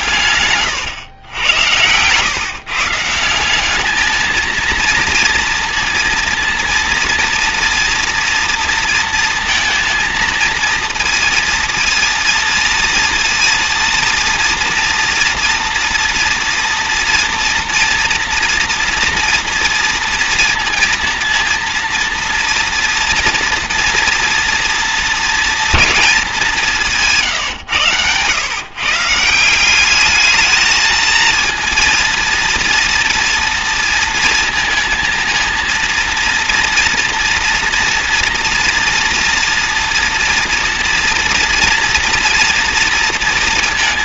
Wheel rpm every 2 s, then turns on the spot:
110, 170, 230, 230, 220, 230, 230, 230, 240, 230, 230, 230, 230, 160, 160, 220, 230, 230, 240, 230, 240, 230.
none